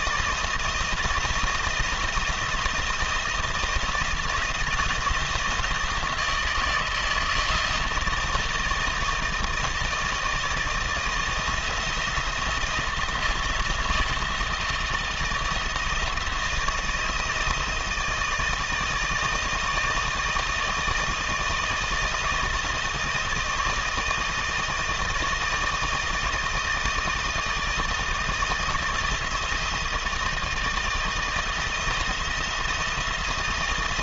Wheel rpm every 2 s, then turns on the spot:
170, 170, 170, 160, 160, 160, 160, 160, 160, 160, 160, 160, 160, 160, 160, 160, 170.
none